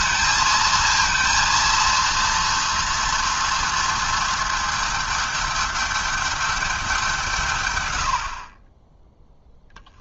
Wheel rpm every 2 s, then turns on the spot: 230, 230, 220, 200, 20.
none